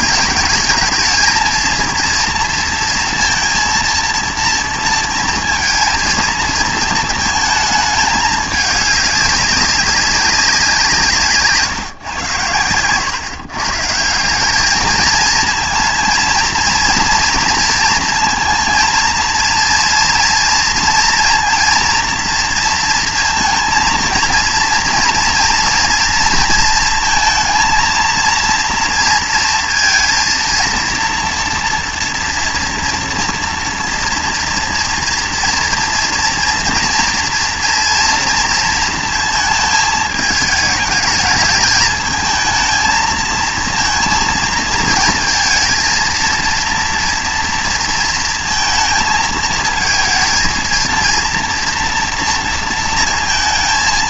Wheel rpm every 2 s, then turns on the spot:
220, 230, 230, 230, 210, 190, 120, 200, 230, 230, 230, 230, 230, 230, 230, 230, 230, 240, 230, 230, 210, 220, 230, 230, 220, 230, 230.
none